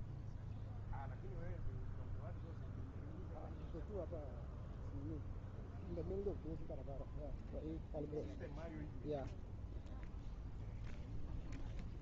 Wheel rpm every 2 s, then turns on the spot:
0, 0, 0, 0, 0, 0.
none